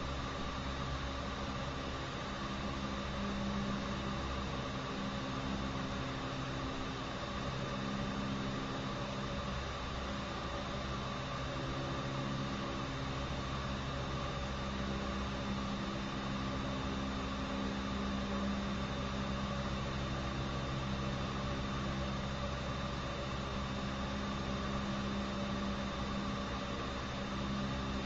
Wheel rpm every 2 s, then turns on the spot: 0, 0, 0, 0, 0, 0, 0, 0, 0, 0, 0, 0, 0, 0.
none